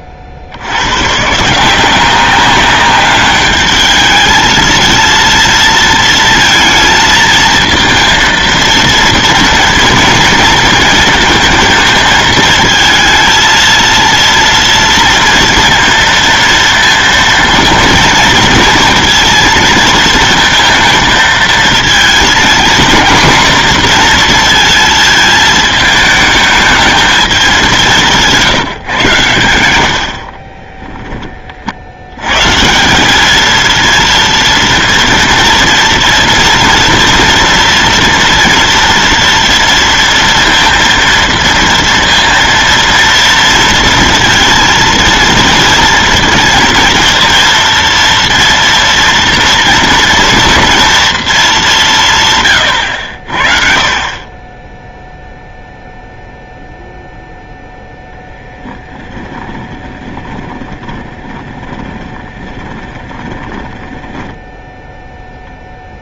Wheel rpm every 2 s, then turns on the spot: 90, 200, 220, 230, 230, 230, 220, 230, 230, 230, 230, 230, 230, 220, 150, 10, 140, 230, 230, 230, 230, 230, 230, 230, 230, 240, 130, 10, 0, 10, 30, 20, 10.
30-32 58-64